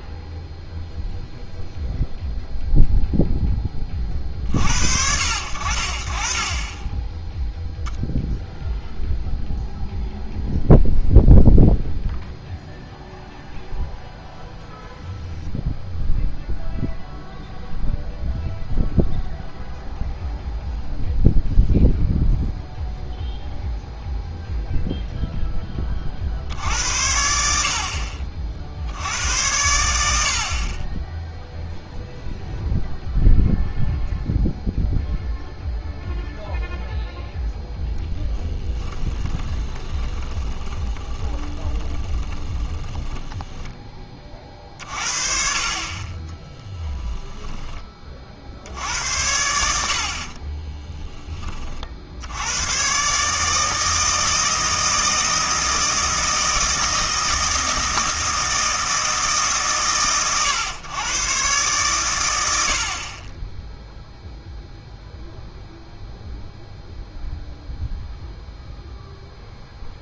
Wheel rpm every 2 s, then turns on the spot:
0, 0, 60, 20, 0, 0, 0, 0, 0, 0, 0, 0, 0, 70, 60, 30, 0, 0, 0, 10, 20, 40, 50, 10, 70, 20, 110, 160, 160, 160, 120, 70, 0, 0, 0.
38-44 46-48 50-52